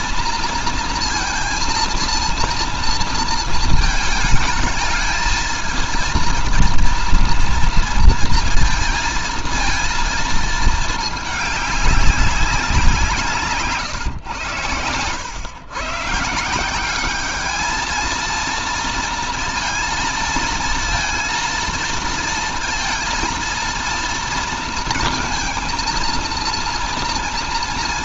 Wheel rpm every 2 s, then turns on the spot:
230, 230, 220, 230, 230, 220, 180, 110, 180, 230, 230, 230, 230, 230.
none